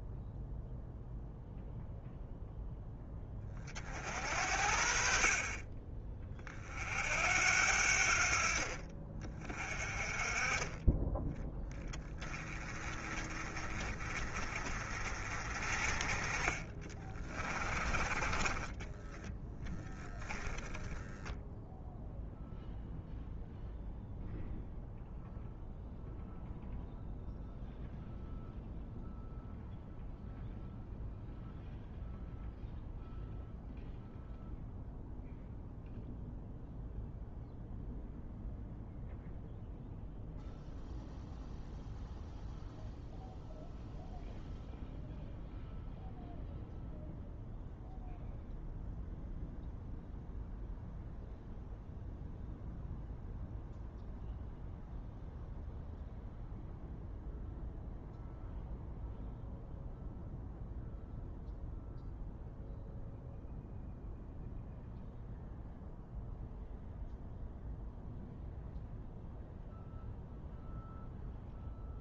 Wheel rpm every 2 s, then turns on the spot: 0, 10, 60, 50, 40, 20, 30, 40, 30, 20, 0, 0, 0, 0, 0, 0, 0, 0, 0, 0, 0, 0, 0, 0, 0, 0, 0, 0, 0, 0, 0, 0, 0, 0, 0, 0.
16-20